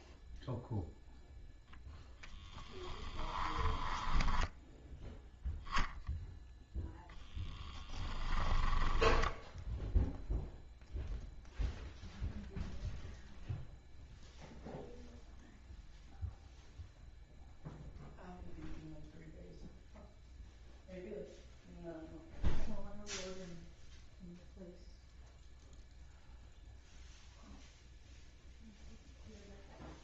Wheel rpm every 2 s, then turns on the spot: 0, 10, 0, 10, 20, 0, 0, 0, 0, 0, 0, 0, 0, 0, 0.
2-4 8-10